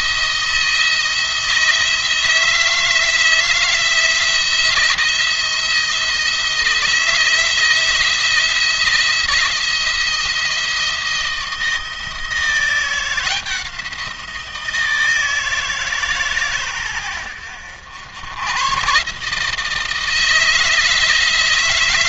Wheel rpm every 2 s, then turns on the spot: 170, 160, 170, 170, 170, 170, 170, 170, 120, 120, 160.
none